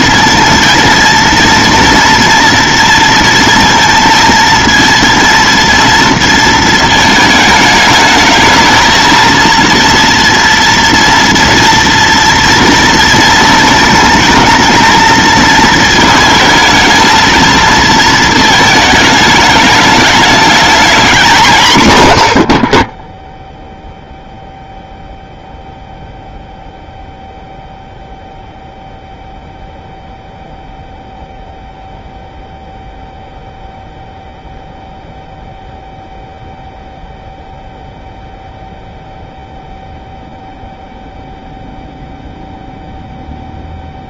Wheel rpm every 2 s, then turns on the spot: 230, 230, 230, 220, 220, 230, 230, 230, 220, 220, 220, 30, 0, 0, 0, 0, 0, 0, 0, 0, 0, 0.
none